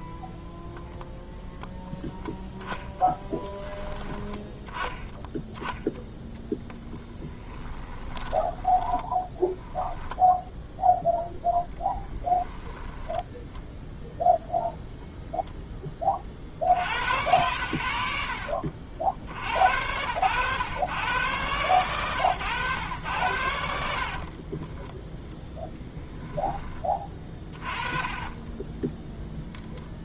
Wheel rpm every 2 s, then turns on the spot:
10, 10, 10, 10, 10, 0, 10, 0, 70, 50, 110, 110, 10, 30, 20.
2-4 6-10 12-14 26-28